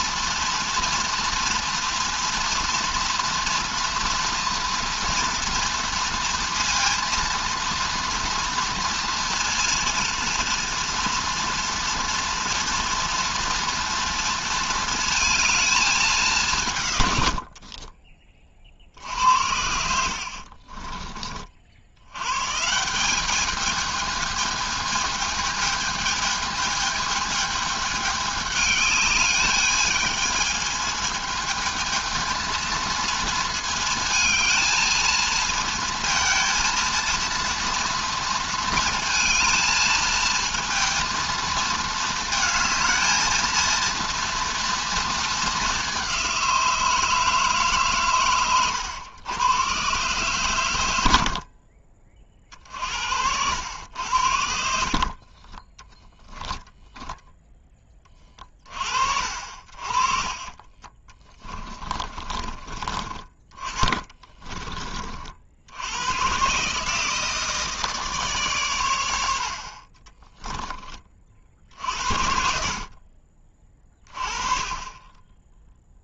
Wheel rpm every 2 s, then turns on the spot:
230, 230, 230, 230, 230, 230, 240, 230, 150, 50, 40, 160, 220, 220, 210, 220, 230, 220, 230, 230, 230, 220, 230, 170, 110, 110, 50, 60, 10, 30, 30, 30, 30, 140, 120, 20, 50, 30.
20-22 56-58